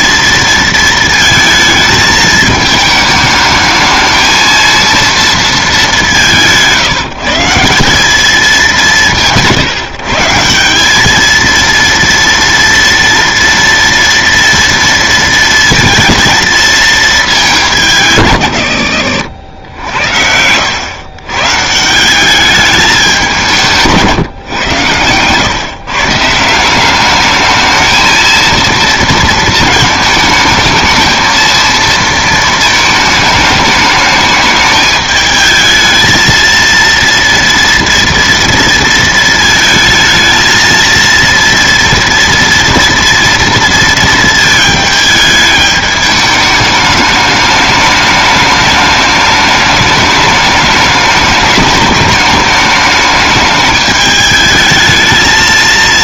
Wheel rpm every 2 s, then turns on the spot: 230, 220, 230, 160, 200, 190, 230, 230, 230, 100, 100, 200, 120, 170, 230, 220, 220, 210, 230, 230, 220, 230, 220, 210, 210, 210, 210, 220.
none